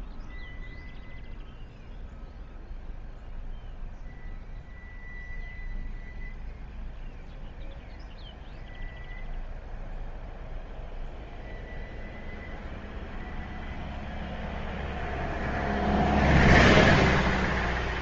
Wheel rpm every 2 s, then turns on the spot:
0, 0, 0, 0, 0, 0, 0, 0, 0.
none